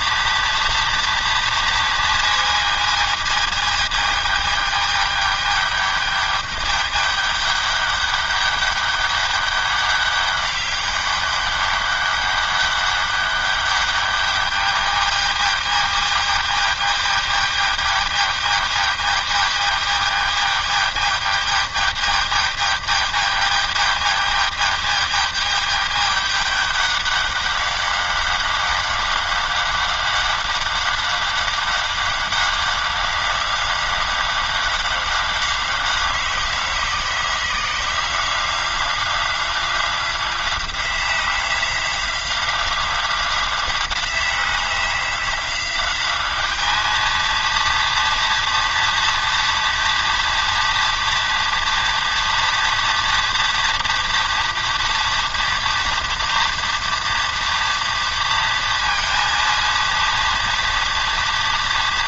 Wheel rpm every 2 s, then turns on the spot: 230, 230, 210, 210, 200, 200, 200, 210, 220, 210, 210, 210, 210, 200, 190, 190, 190, 190, 190, 180, 180, 180, 180, 210, 230, 240, 230, 230, 230, 230, 230.
none